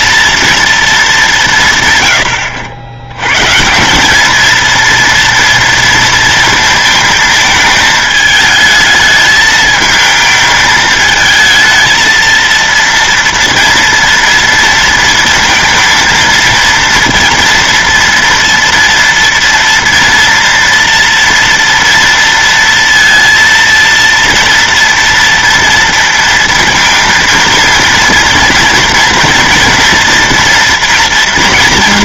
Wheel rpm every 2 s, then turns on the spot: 230, 90, 230, 230, 220, 220, 230, 230, 230, 230, 230, 230, 230, 230, 230, 230.
none